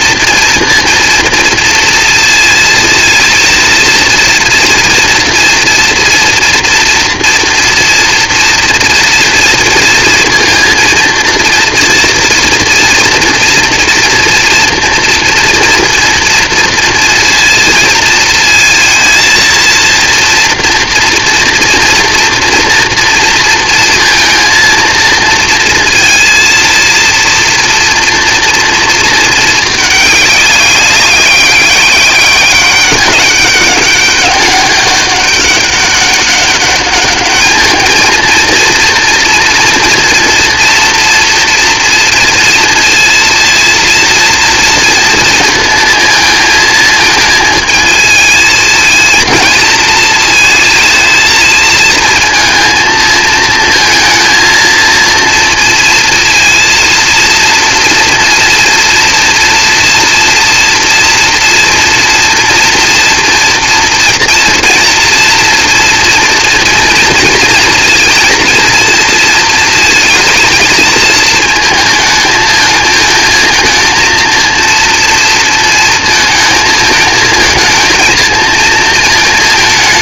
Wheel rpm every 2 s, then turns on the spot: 230, 230, 240, 240, 230, 230, 230, 230, 230, 230, 240, 240, 230, 230, 230, 200, 200, 200, 200, 230, 230, 230, 230, 220, 230, 220, 230, 230, 230, 230, 230, 230, 230, 230, 230, 220, 220, 230, 220, 220.
none